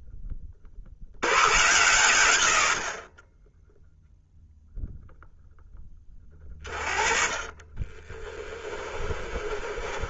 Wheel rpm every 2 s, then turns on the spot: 50, 60, 0, 30, 20.
8-10